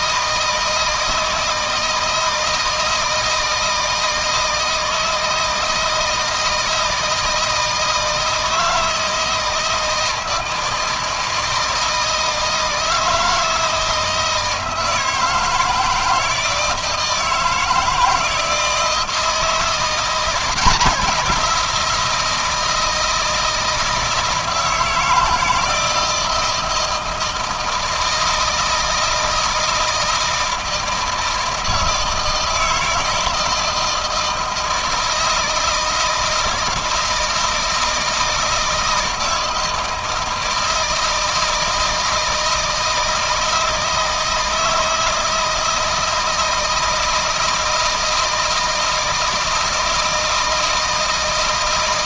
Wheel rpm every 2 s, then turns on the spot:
160, 160, 160, 160, 160, 160, 160, 160, 160, 160, 180, 170, 160, 160, 160, 160, 160, 160, 160, 160, 160, 160, 160, 160, 160, 160.
none